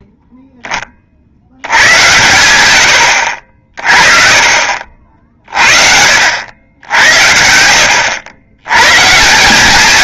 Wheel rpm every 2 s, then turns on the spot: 20, 100, 50, 90, 120.
none